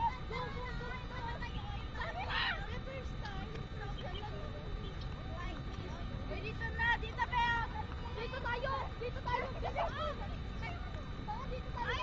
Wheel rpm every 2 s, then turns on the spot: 0, 0, 0, 0, 0, 0.
none